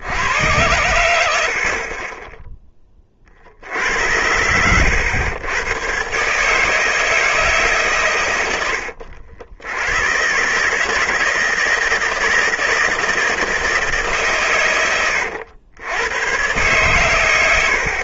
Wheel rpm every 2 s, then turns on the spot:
100, 10, 90, 160, 90, 140, 160, 110, 120.
none